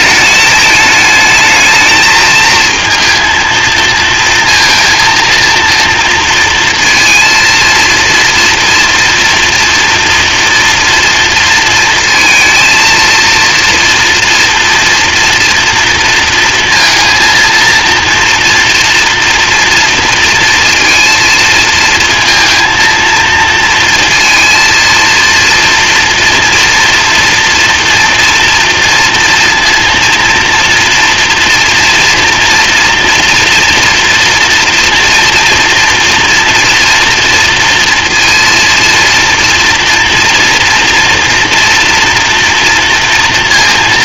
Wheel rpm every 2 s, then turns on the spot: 210, 230, 230, 230, 240, 230, 230, 230, 230, 230, 230, 230, 230, 230, 230, 230, 230, 240, 230, 230, 230, 230.
none